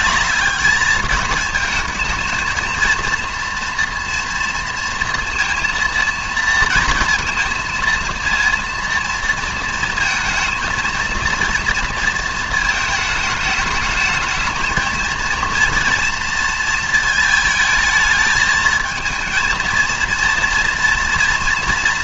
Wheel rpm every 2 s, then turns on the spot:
210, 230, 230, 230, 230, 230, 220, 220, 230, 220, 230.
none